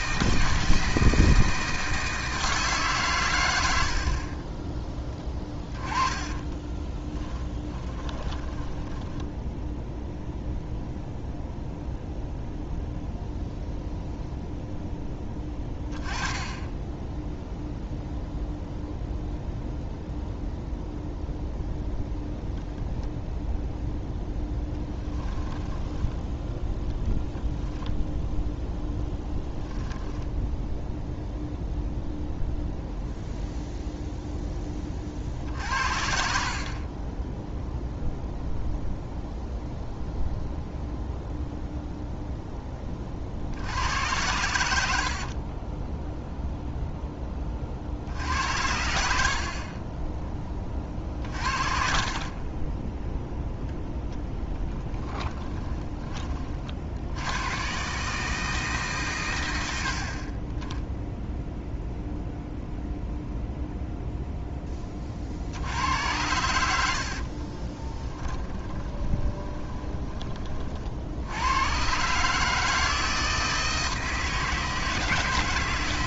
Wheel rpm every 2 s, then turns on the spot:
160, 140, 20, 30, 10, 0, 0, 0, 10, 0, 0, 0, 10, 10, 0, 0, 0, 30, 40, 0, 0, 20, 80, 0, 80, 30, 20, 10, 60, 140, 10, 0, 20, 90, 20, 50, 160, 160.
6-10 24-26 54-56 66-70